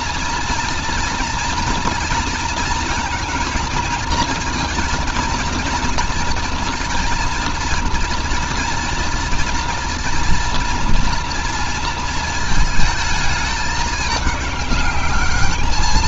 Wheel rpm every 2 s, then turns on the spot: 240, 230, 230, 230, 230, 230, 220, 200.
none